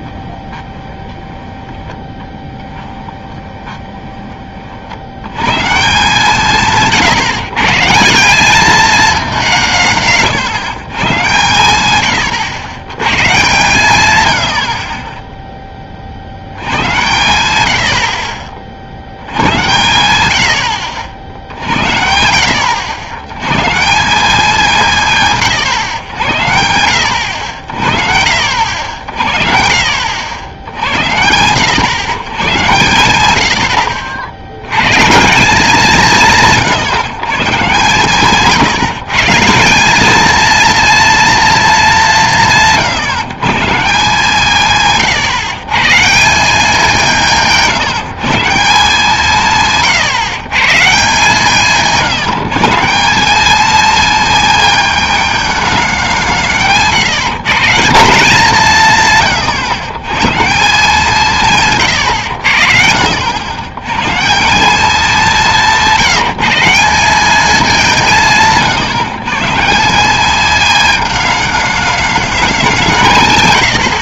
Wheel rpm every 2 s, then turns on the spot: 20, 10, 30, 160, 210, 150, 110, 80, 100, 50, 90, 80, 190, 90, 60, 80, 120, 100, 150, 150, 220, 150, 160, 190, 170, 140, 170, 230, 170, 170, 160, 60, 200, 170, 170, 220, 180.
0-4 68-70